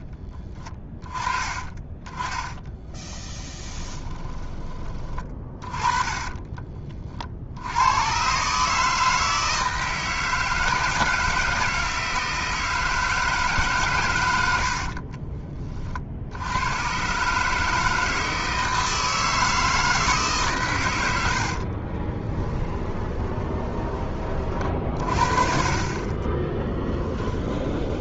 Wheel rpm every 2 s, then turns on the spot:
20, 20, 30, 30, 150, 160, 160, 60, 100, 160, 110, 20, 40, 10.
2-4 22-24 26-28